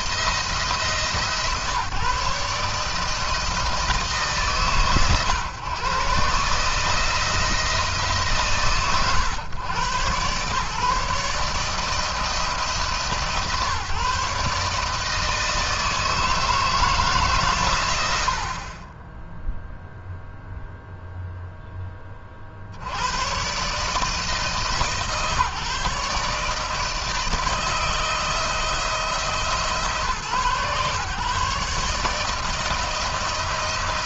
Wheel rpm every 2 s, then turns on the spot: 160, 150, 140, 150, 130, 140, 150, 150, 160, 30, 0, 60, 150, 160, 160, 130, 160.
none